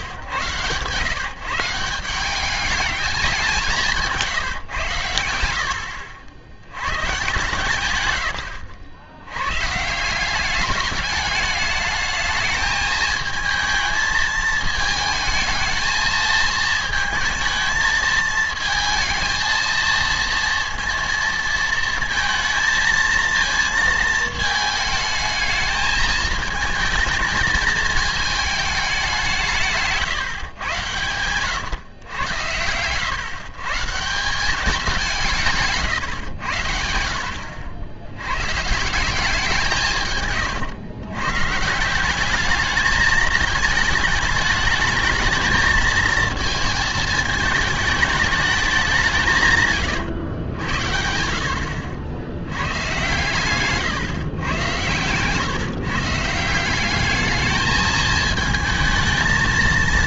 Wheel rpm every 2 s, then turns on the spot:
120, 210, 140, 120, 50, 200, 220, 220, 220, 220, 230, 220, 220, 220, 210, 120, 90, 190, 90, 150, 120, 210, 210, 220, 200, 90, 100, 120, 170, 220.
none